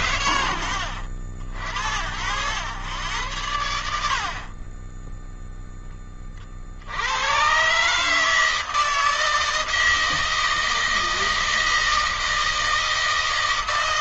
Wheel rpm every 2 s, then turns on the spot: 130, 90, 30, 50, 160, 160, 160.
none